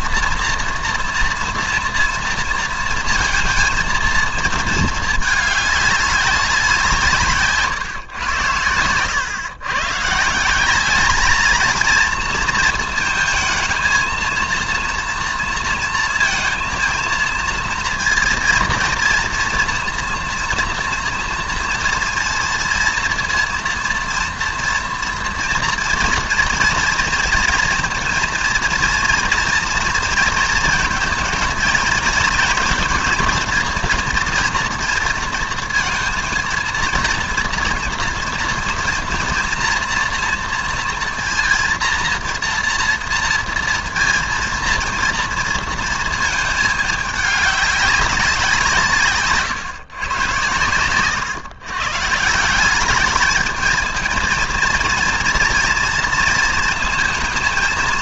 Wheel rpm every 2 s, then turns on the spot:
230, 230, 220, 180, 100, 190, 230, 230, 230, 230, 240, 230, 230, 230, 230, 230, 230, 240, 230, 230, 230, 240, 230, 220, 180, 120, 180, 230, 230.
none